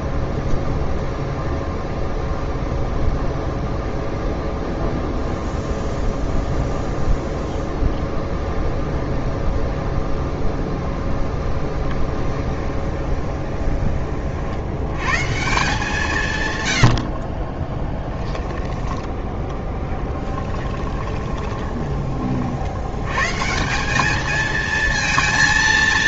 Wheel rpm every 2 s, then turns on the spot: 0, 0, 0, 0, 0, 0, 10, 90, 90, 20, 20, 80, 220.
12-14 18-22